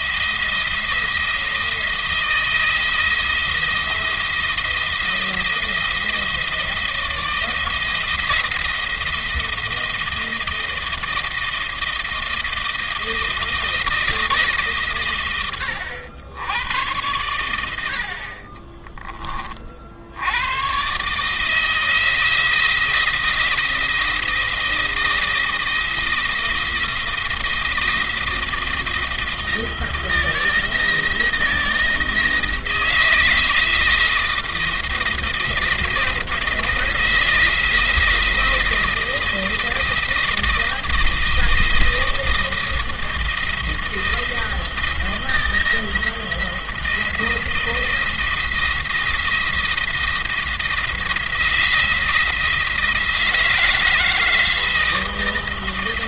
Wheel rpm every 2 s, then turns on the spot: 170, 160, 170, 160, 170, 160, 170, 120, 90, 20, 130, 170, 170, 170, 170, 170, 160, 170, 170, 170, 170, 170, 170, 170, 170, 170, 170, 170.
none